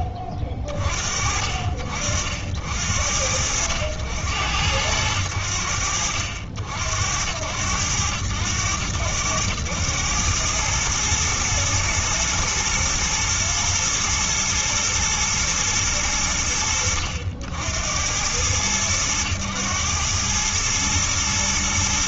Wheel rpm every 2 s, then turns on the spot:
30, 80, 80, 70, 90, 110, 110, 110, 60, 100, 110.
none